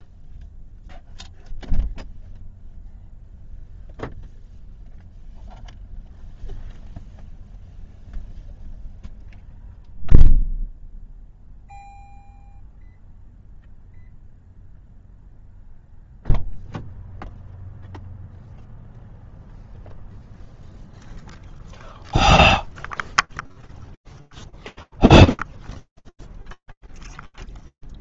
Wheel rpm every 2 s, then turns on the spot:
0, 0, 0, 0, 0, 0, 0, 0, 0, 0, 0, 0, 0, 0.
none